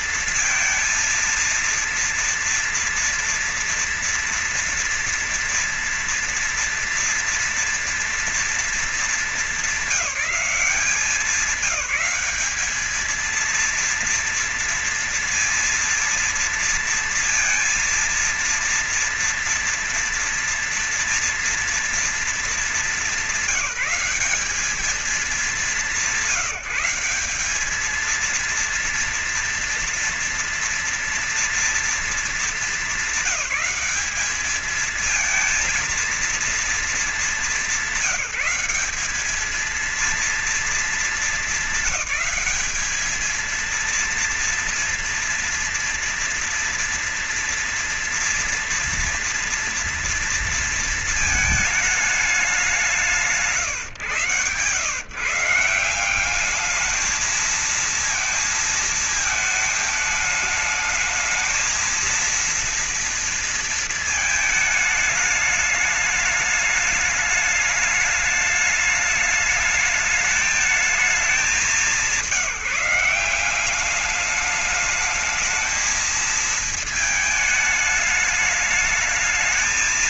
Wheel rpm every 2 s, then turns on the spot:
230, 230, 230, 240, 230, 210, 220, 230, 230, 230, 230, 210, 200, 190, 230, 230, 210, 210, 230, 200, 230, 210, 230, 230, 230, 230, 200, 140, 200, 220, 220, 230, 220, 210, 210, 210, 180, 210, 220, 210.
none